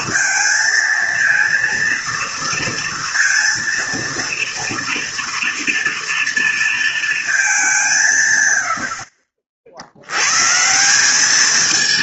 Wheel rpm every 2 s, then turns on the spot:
230, 230, 230, 230, 70, 180.
none